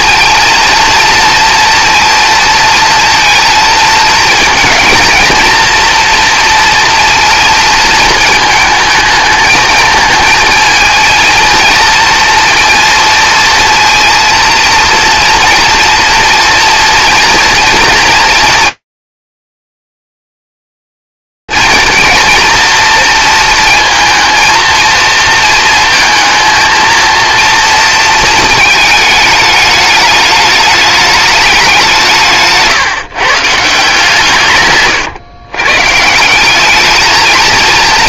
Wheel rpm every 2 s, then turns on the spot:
230, 230, 230, 230, 220, 230, 230, 230, 240, 230, 230, 230, 230, 210, 200, 160, 120, 220, 230.
none